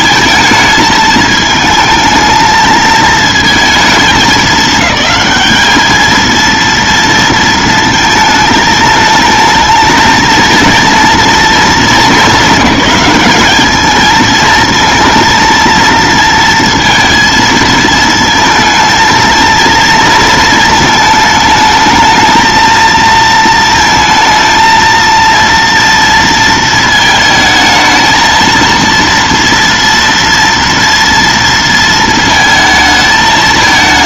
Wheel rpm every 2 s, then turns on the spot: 220, 220, 210, 230, 220, 230, 210, 230, 230, 220, 220, 220, 220, 230, 230, 230, 220.
none